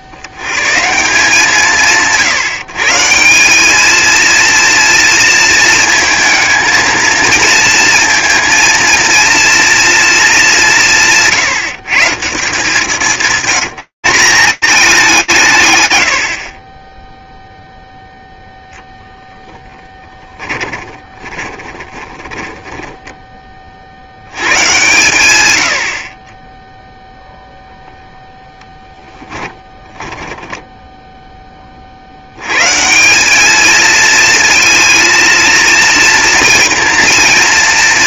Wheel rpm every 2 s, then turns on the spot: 70, 140, 230, 230, 230, 230, 160, 200, 100, 0, 20, 10, 110, 0, 10, 10, 190, 230, 240.
20-24 28-30